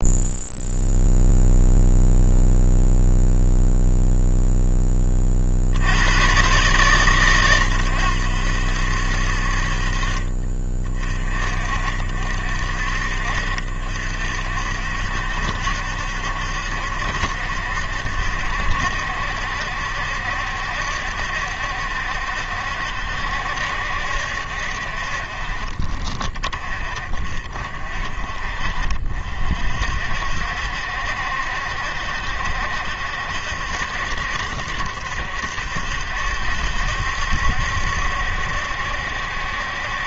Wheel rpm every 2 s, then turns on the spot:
0, 0, 0, 120, 70, 30, 60, 60, 70, 70, 70, 70, 60, 30, 40, 60, 70, 70, 70, 70.
none